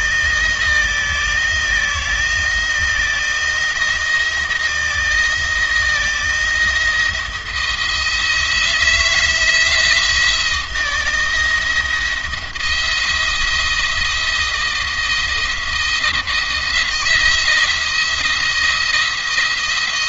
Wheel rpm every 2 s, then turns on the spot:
170, 170, 160, 170, 160, 160, 170, 170, 170, 170.
none